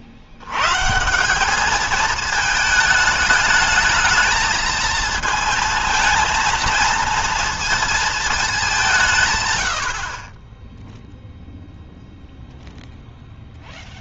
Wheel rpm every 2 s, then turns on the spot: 100, 220, 220, 230, 220, 20, 0.
none